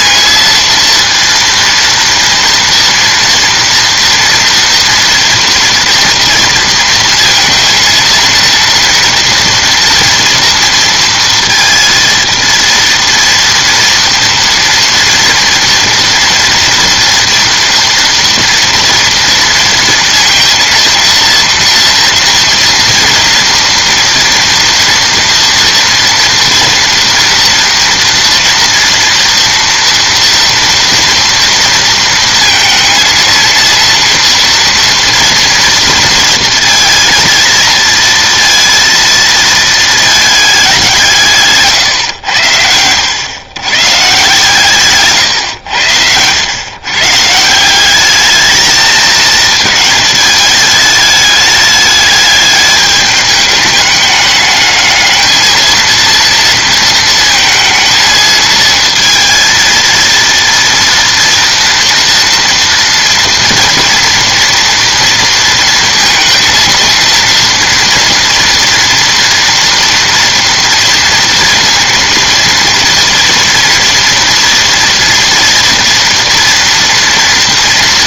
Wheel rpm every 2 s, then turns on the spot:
230, 230, 240, 230, 230, 230, 230, 230, 230, 230, 230, 230, 230, 240, 230, 230, 230, 230, 230, 230, 190, 100, 140, 120, 220, 210, 210, 210, 230, 220, 230, 230, 230, 230, 240, 230, 230, 230, 230.
42-44